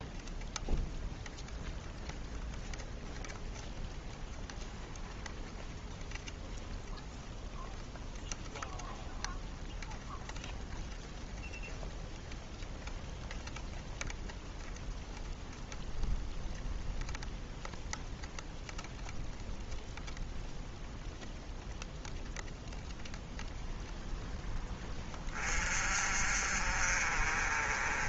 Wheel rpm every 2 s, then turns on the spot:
0, 0, 0, 0, 0, 0, 0, 0, 0, 0, 0, 0, 10, 40.
none